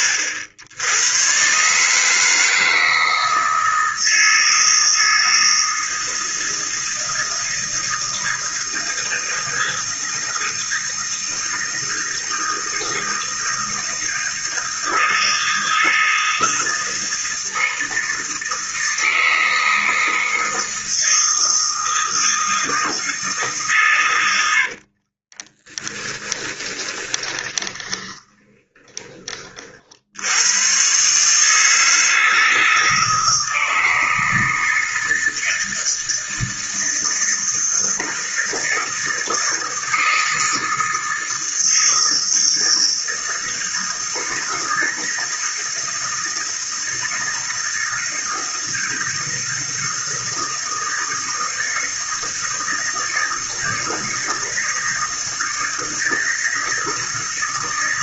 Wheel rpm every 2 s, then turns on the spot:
90, 160, 160, 160, 160, 160, 160, 160, 160, 160, 160, 160, 60, 20, 20, 110, 160, 160, 160, 160, 160, 160, 160, 160, 160, 160, 160, 160, 160.
24-30